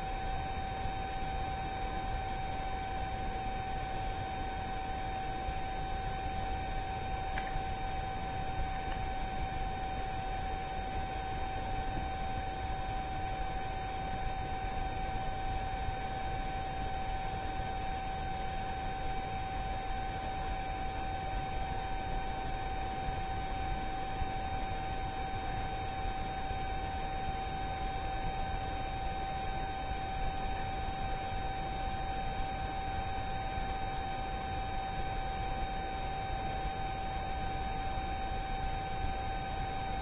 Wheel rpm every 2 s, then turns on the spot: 0, 0, 0, 0, 0, 0, 0, 0, 0, 0, 0, 0, 0, 0, 0, 0, 0, 0, 0, 0.
none